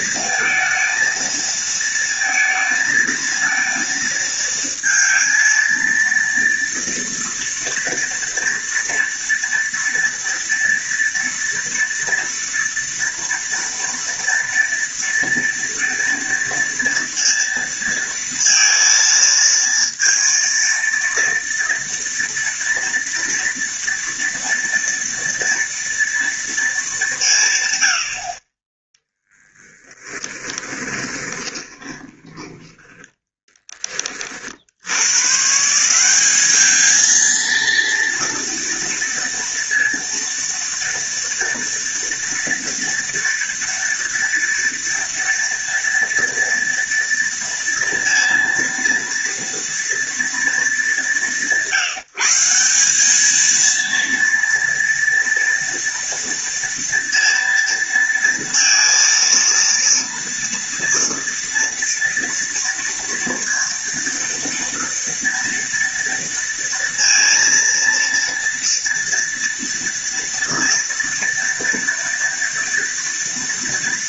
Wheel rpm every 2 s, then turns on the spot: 230, 230, 230, 230, 230, 230, 230, 230, 230, 230, 230, 230, 230, 210, 20, 20, 20, 80, 210, 230, 230, 230, 230, 230, 230, 210, 190, 230, 230, 230, 230, 230, 230, 230, 230, 230, 230.
30-34